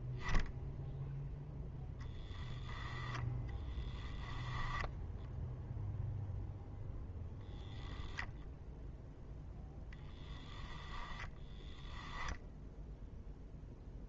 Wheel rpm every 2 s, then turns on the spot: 0, 10, 0, 10, 0, 0, 0.
2-4